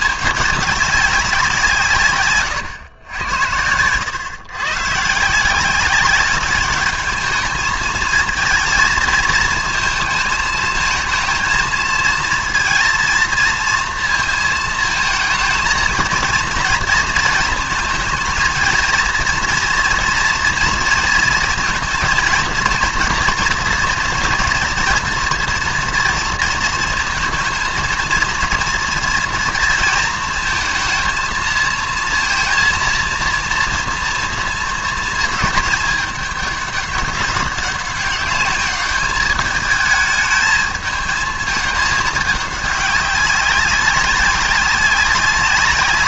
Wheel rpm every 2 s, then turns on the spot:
200, 130, 120, 200, 230, 220, 230, 230, 230, 230, 230, 230, 230, 230, 230, 220, 230, 230, 200, 210, 220, 200, 190.
none